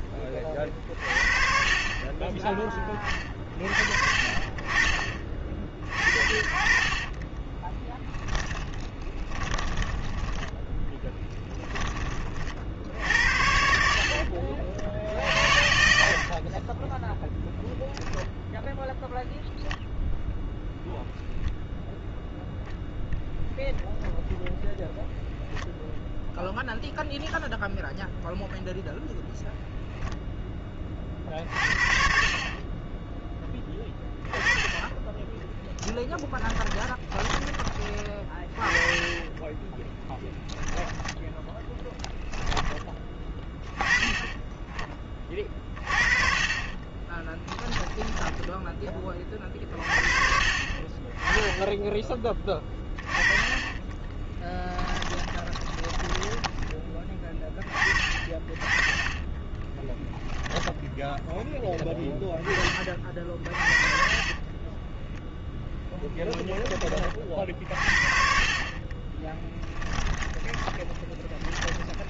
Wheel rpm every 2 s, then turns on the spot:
30, 30, 40, 30, 10, 10, 60, 60, 20, 0, 0, 0, 0, 0, 0, 20, 20, 10, 10, 20, 10, 10, 20, 20, 20, 30, 20, 20, 20, 40, 0, 20, 10, 30, 30, 20.
8-12 14-18 36-38 40-42 54-56 64-66 70-72